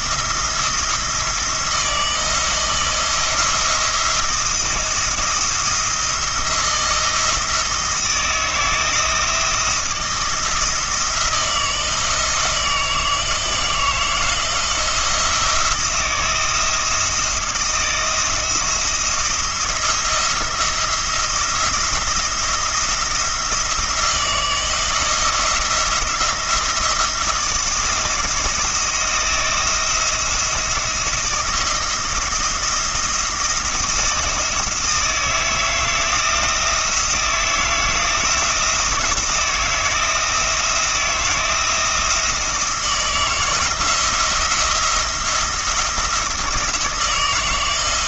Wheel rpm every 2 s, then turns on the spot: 170, 160, 160, 170, 160, 170, 160, 170, 160, 170, 170, 170, 170, 170, 170, 170, 170, 160, 160, 160, 170, 160, 170, 160.
none